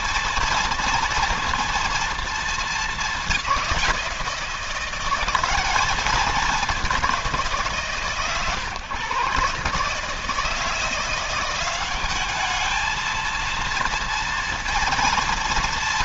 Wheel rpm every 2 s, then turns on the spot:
230, 210, 180, 190, 130, 160, 220, 230.
none